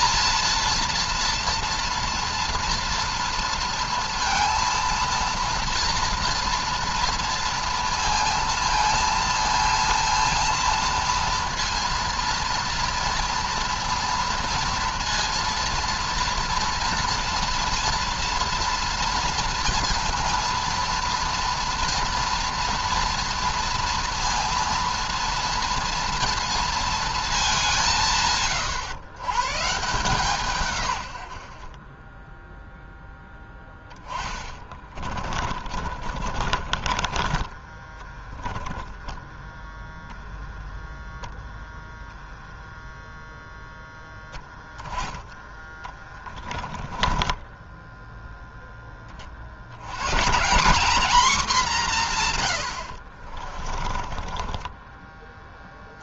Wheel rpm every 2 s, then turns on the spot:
230, 230, 230, 230, 230, 230, 230, 230, 230, 230, 240, 230, 240, 230, 130, 110, 0, 30, 30, 20, 0, 0, 10, 20, 20, 210, 80, 20.
34-38 46-48 52-56